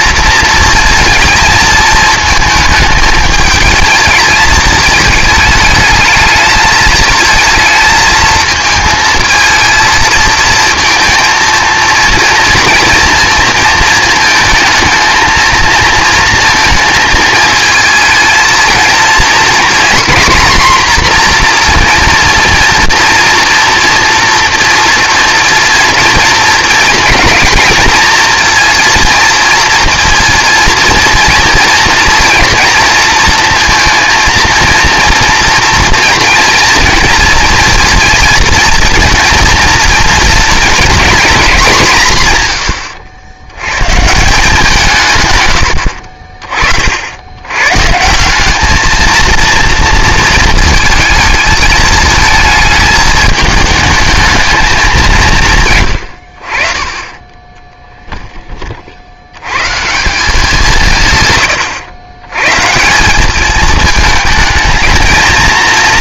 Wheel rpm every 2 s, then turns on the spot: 230, 220, 220, 220, 220, 230, 230, 220, 230, 230, 250, 230, 230, 230, 230, 230, 230, 230, 230, 230, 230, 110, 170, 50, 210, 220, 220, 210, 40, 20, 180, 140, 220.
none